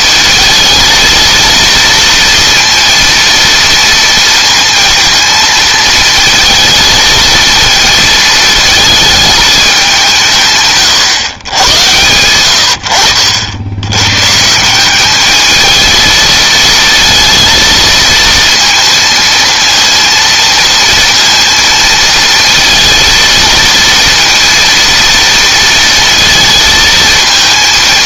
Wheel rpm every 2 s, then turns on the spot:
220, 230, 230, 230, 220, 130, 70, 170, 220, 230, 230, 230, 230, 230.
none